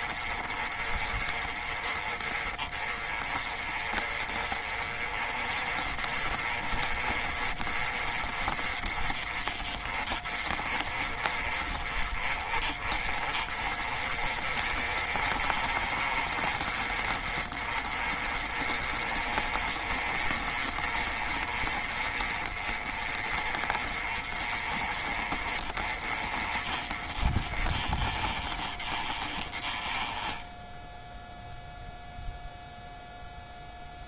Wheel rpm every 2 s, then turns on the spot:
30, 30, 30, 30, 30, 30, 30, 30, 30, 30, 30, 30, 30, 30, 20, 0, 0.
none